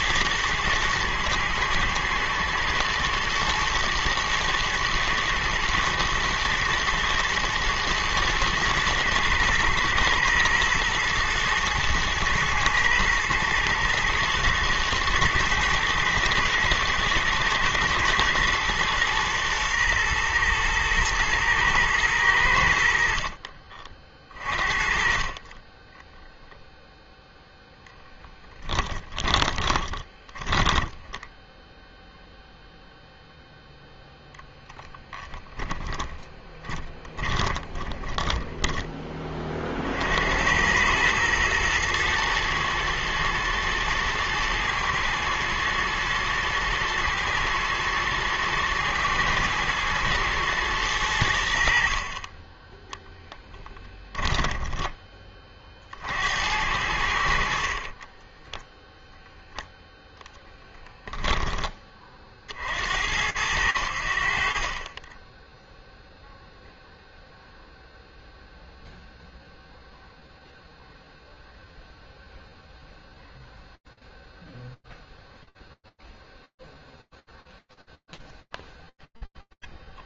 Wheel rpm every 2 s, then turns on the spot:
110, 110, 110, 110, 120, 120, 110, 110, 110, 120, 110, 80, 40, 0, 10, 20, 0, 10, 20, 10, 90, 110, 110, 110, 110, 110, 10, 10, 80, 10, 10, 60, 30, 0, 0, 0, 0, 0, 0, 0.
28-32 34-40 54-56 58-62